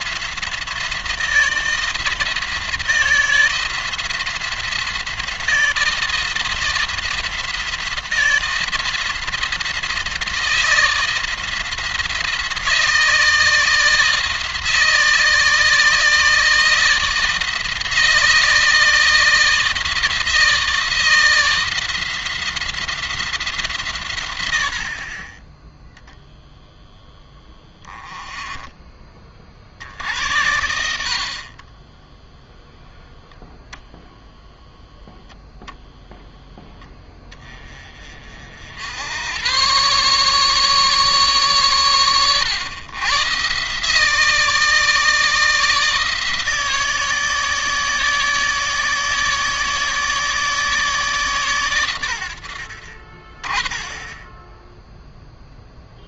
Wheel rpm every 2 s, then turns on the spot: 170, 170, 170, 170, 170, 170, 170, 160, 160, 160, 160, 170, 70, 0, 20, 70, 0, 0, 10, 80, 150, 110, 160, 160, 160, 150, 60, 0.
none